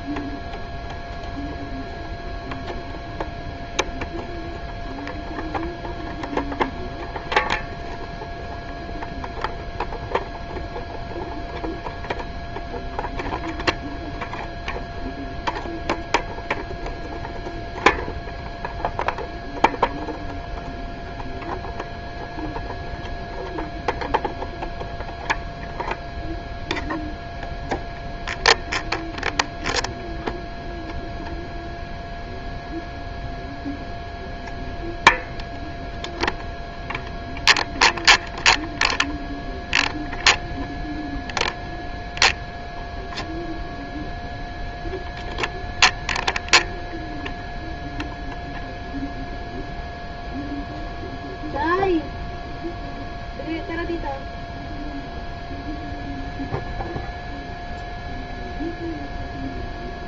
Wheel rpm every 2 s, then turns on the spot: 0, 0, 0, 0, 0, 0, 0, 0, 0, 0, 0, 0, 0, 0, 0, 0, 0, 0, 0, 0, 0, 0, 0, 0, 0, 0, 0, 0, 0, 0.
none